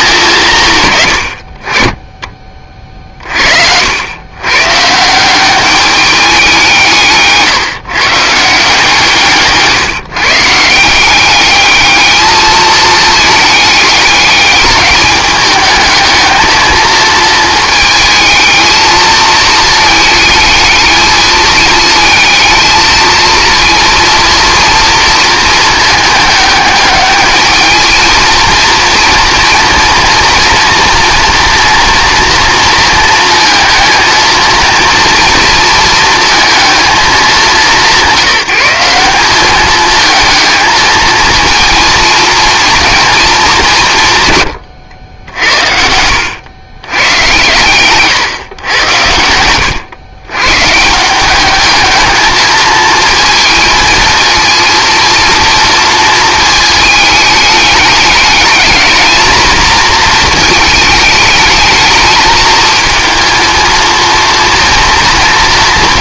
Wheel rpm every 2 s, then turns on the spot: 140, 30, 140, 170, 160, 160, 220, 210, 220, 220, 220, 220, 230, 210, 230, 230, 230, 230, 220, 180, 220, 230, 110, 110, 120, 150, 220, 230, 220, 210, 220, 220, 230.
none